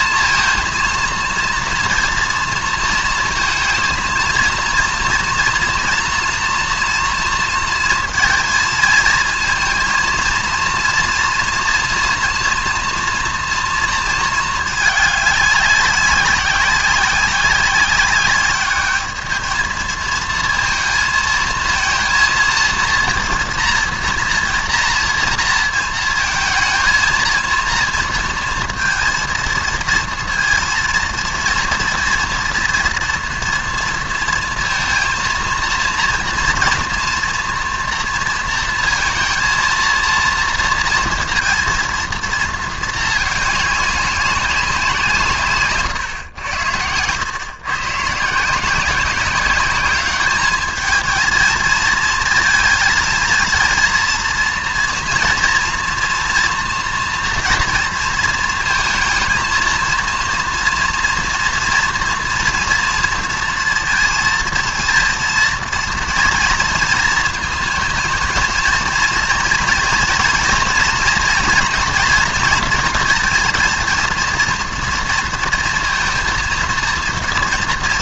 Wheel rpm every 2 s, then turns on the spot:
230, 230, 240, 230, 230, 230, 230, 220, 190, 210, 230, 230, 230, 220, 230, 230, 240, 230, 230, 230, 230, 220, 170, 100, 180, 220, 230, 230, 230, 230, 230, 230, 230, 230, 230, 230, 230, 230, 230.
46-48